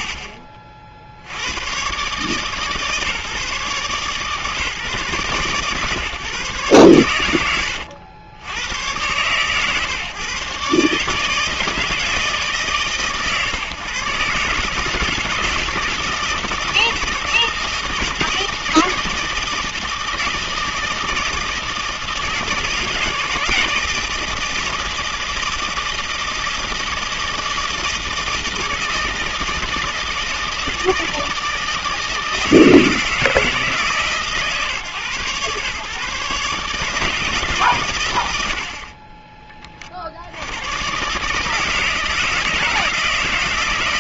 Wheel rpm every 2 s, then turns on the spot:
40, 150, 150, 120, 110, 140, 150, 150, 160, 160, 160, 160, 160, 160, 160, 170, 160, 140, 150, 60, 100, 160.
none